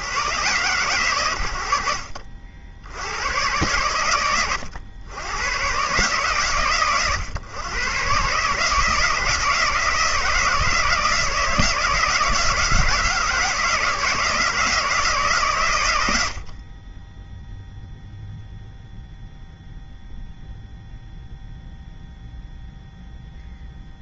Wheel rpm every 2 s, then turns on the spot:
70, 110, 110, 120, 160, 160, 160, 130, 0, 0, 0, 0.
none